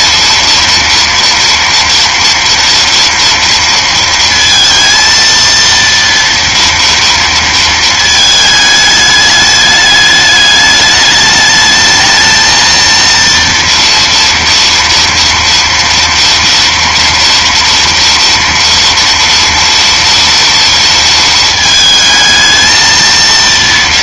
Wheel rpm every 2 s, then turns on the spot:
240, 230, 230, 230, 210, 210, 230, 230, 230, 230, 230, 220.
none